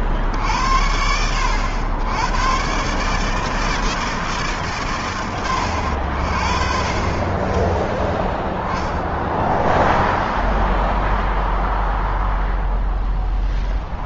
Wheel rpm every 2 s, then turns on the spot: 110, 150, 60, 0, 0, 0, 0.
none